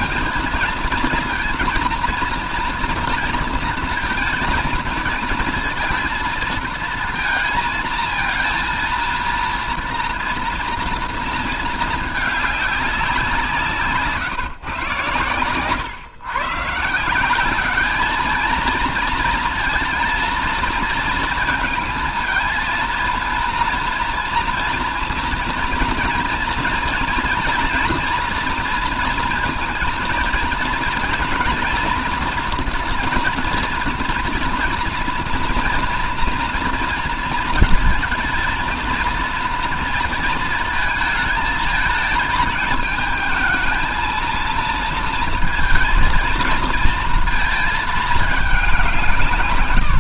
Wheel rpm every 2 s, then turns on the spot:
230, 230, 220, 220, 230, 230, 200, 130, 140, 220, 230, 230, 230, 230, 230, 220, 230, 240, 240, 230, 230, 220, 230, 230, 190.
none